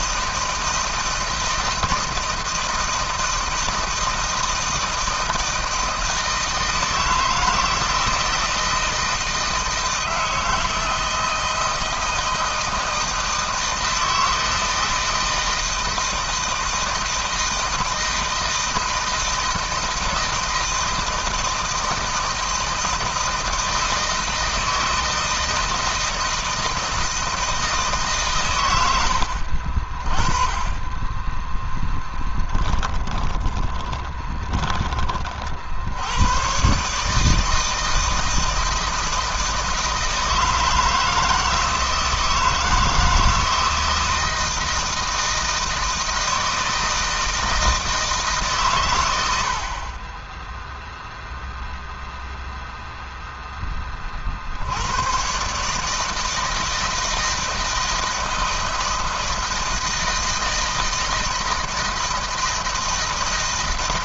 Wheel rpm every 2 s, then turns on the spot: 160, 160, 160, 160, 160, 160, 160, 160, 160, 160, 160, 160, 160, 160, 120, 30, 10, 10, 120, 160, 160, 160, 160, 160, 140, 10, 0, 50, 160, 160, 160, 160.
32-36